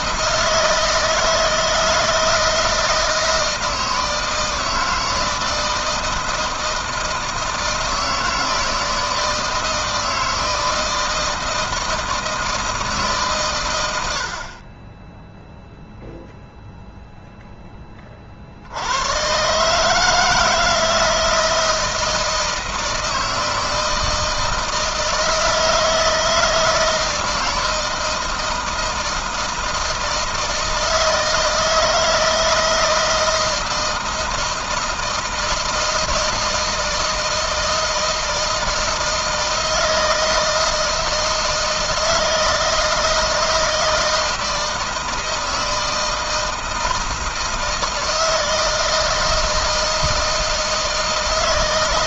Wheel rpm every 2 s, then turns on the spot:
160, 160, 160, 160, 160, 160, 150, 20, 0, 90, 160, 160, 160, 160, 160, 160, 160, 160, 160, 160, 160, 160, 160, 160, 160, 160.
none